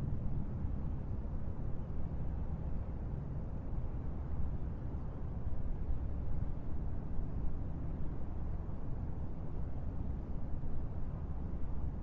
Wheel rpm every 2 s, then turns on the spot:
0, 0, 0, 0, 0, 0.
none